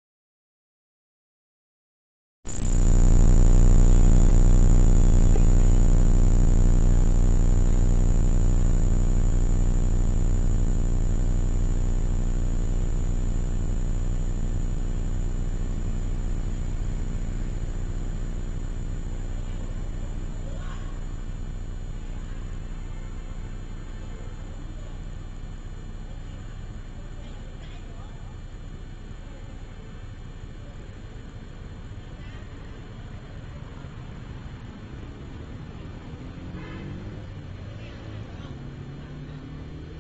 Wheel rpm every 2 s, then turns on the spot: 0, 0, 0, 0, 0, 0, 0, 0, 0, 0, 0, 0, 0, 0, 0, 0, 0, 0, 0, 0.
none